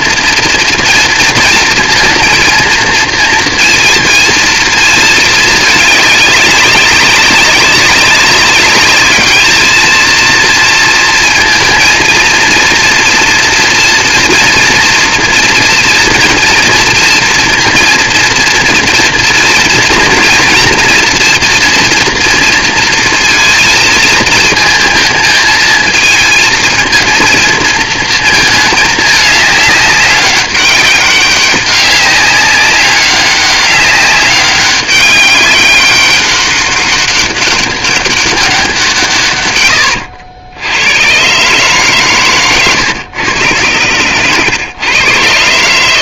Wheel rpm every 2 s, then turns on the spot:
230, 230, 220, 200, 200, 230, 230, 230, 230, 230, 230, 230, 220, 230, 220, 200, 200, 200, 200, 190, 80, 120, 110.
none